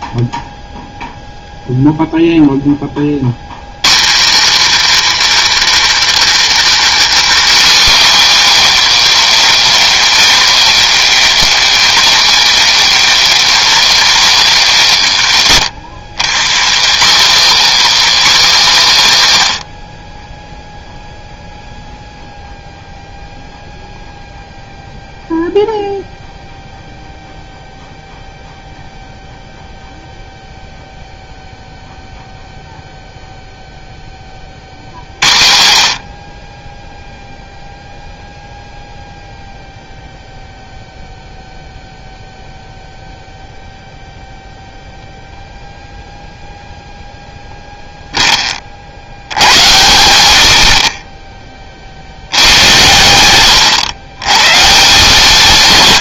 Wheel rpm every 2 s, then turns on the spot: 0, 40, 350, 360, 280, 230, 230, 180, 230, 210, 0, 0, 0, 0, 0, 0, 0, 90, 0, 0, 0, 0, 0, 0, 60, 30, 100, 150.
none